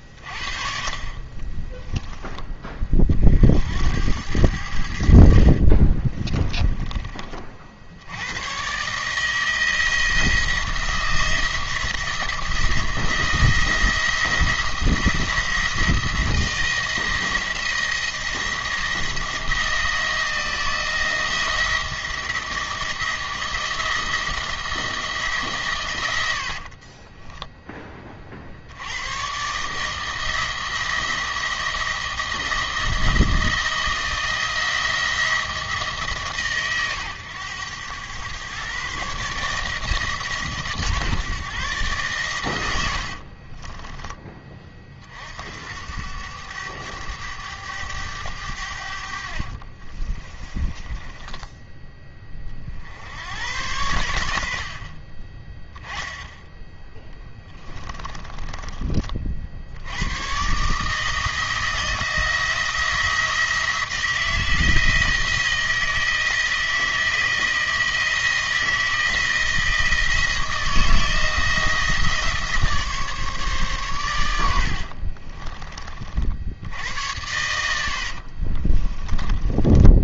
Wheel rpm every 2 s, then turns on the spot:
40, 20, 90, 20, 120, 170, 170, 170, 170, 170, 170, 160, 170, 50, 70, 160, 170, 170, 130, 130, 150, 90, 30, 100, 80, 20, 40, 70, 10, 30, 140, 170, 170, 160, 170, 160, 150, 80, 70, 30.
6-8 26-28 50-52 74-76 78-80